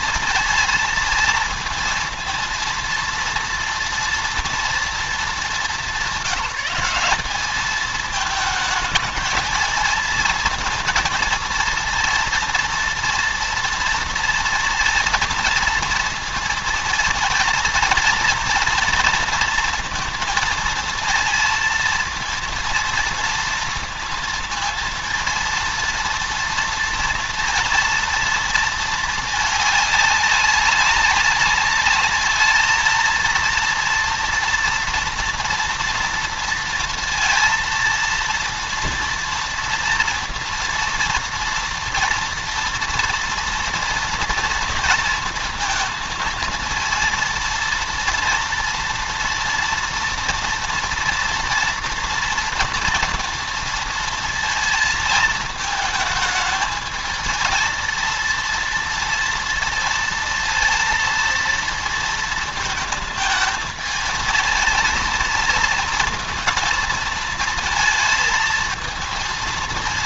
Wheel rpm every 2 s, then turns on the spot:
230, 230, 230, 190, 220, 230, 230, 230, 230, 230, 230, 230, 230, 230, 220, 200, 220, 230, 230, 230, 230, 230, 230, 230, 230, 230, 230, 220, 220, 230, 230, 220, 220, 220, 220.
none